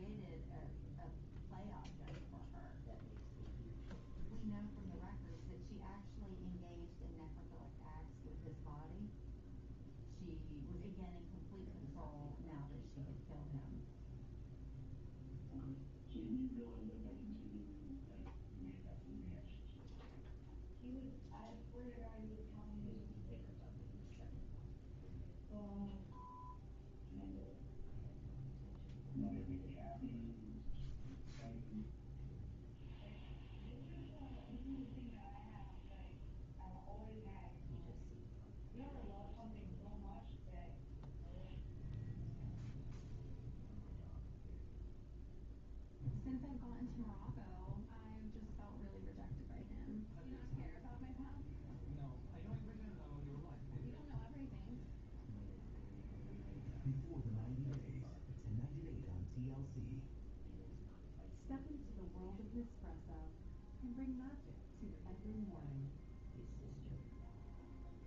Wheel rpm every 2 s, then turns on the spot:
0, 0, 0, 0, 0, 0, 0, 0, 0, 0, 0, 0, 0, 0, 0, 0, 0, 0, 0, 0, 0, 0, 0, 0, 0, 0, 0, 0, 0, 0, 0, 0, 0, 0.
none